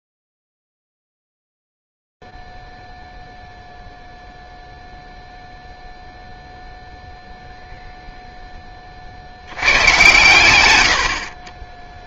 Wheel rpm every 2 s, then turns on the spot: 0, 0, 0, 0, 10, 120.
none